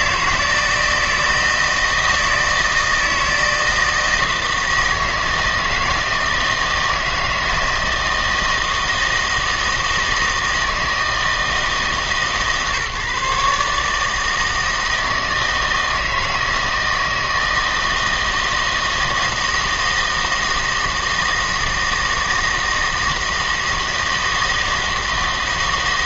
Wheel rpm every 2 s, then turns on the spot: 160, 160, 160, 160, 160, 160, 150, 160, 160, 160, 160, 160, 160.
none